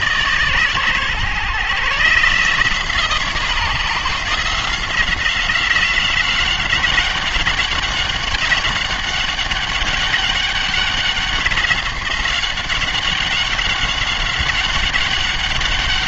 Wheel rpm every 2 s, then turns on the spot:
130, 160, 170, 190, 200, 190, 190, 190.
none